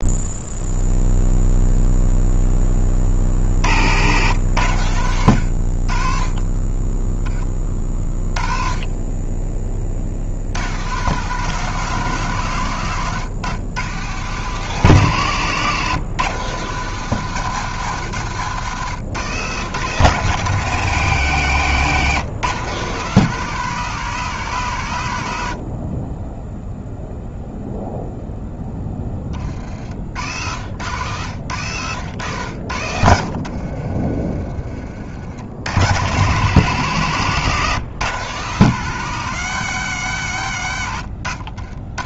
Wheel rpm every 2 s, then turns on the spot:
0, 20, 100, 10, 30, 100, 130, 140, 130, 120, 150, 130, 110, 0, 10, 80, 80, 40, 120, 130, 90.
30-34